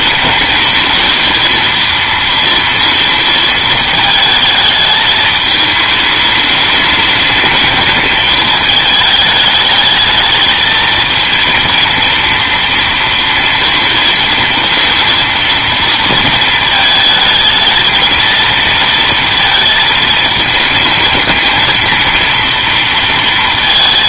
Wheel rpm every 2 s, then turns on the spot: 220, 230, 220, 210, 220, 220, 230, 230, 220, 230, 220, 230.
none